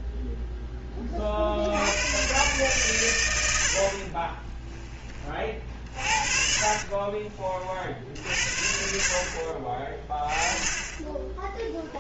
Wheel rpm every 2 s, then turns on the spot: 0, 120, 20, 40, 60, 20.
4-8